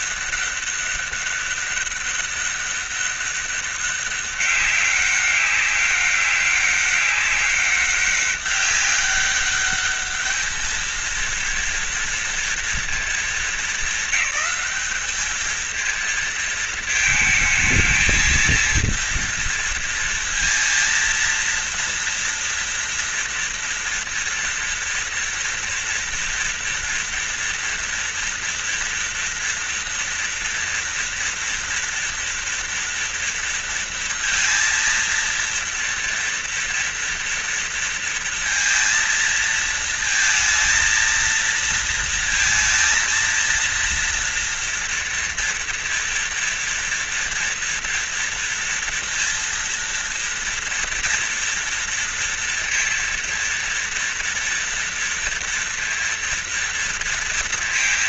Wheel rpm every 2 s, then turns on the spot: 200, 200, 200, 200, 200, 220, 230, 200, 230, 230, 230, 230, 230, 240, 240, 230, 230, 230, 230, 230, 230, 230, 230, 230, 230, 230, 230, 230, 230.
none